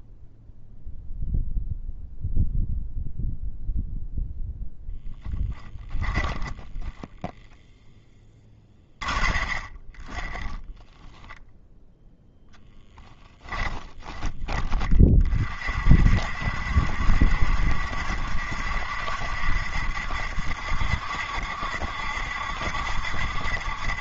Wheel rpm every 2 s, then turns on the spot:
0, 0, 0, 10, 20, 10, 0, 20, 70, 70, 60, 70.
6-8 10-12